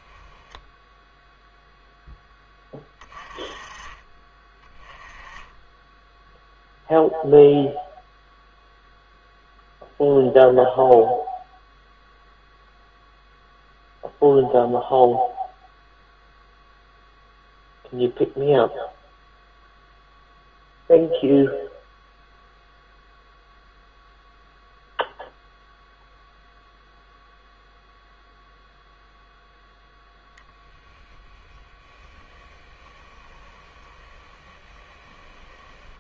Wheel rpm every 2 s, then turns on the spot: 10, 10, 20, 0, 0, 0, 0, 0, 0, 0, 0, 0, 0, 0, 0, 20, 10, 10.
32-36